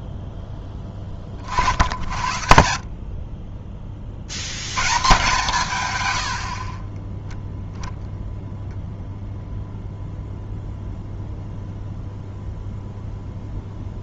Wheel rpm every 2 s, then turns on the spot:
10, 70, 110, 40, 0, 0, 0.
6-8